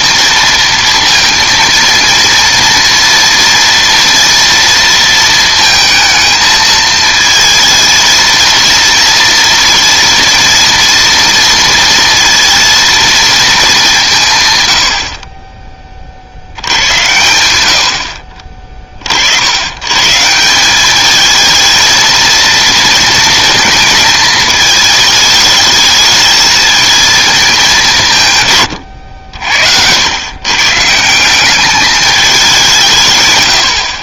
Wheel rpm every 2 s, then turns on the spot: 230, 230, 230, 220, 230, 230, 230, 100, 90, 30, 190, 230, 220, 220, 120, 130, 190.
none